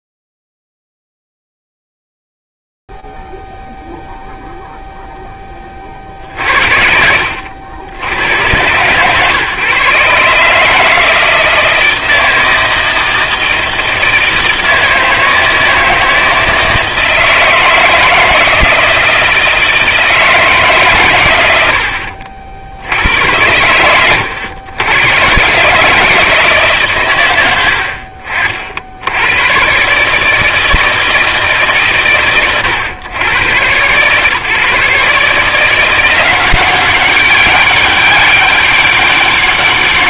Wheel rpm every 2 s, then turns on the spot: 0, 0, 0, 40, 90, 150, 160, 160, 160, 160, 160, 70, 100, 160, 60, 150, 120, 130, 180, 190.
none